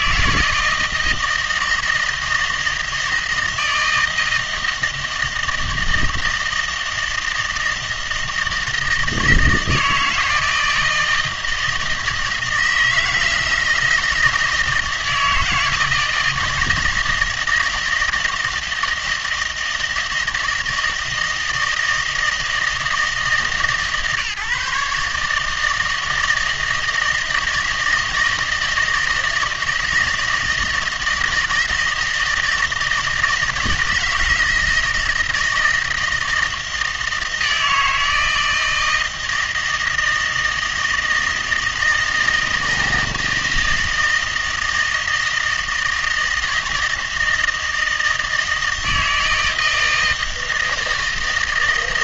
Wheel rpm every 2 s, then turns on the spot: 160, 160, 160, 160, 160, 160, 160, 160, 160, 160, 160, 160, 150, 160, 160, 160, 170, 160, 160, 160, 160, 160, 160, 160, 160, 160.
none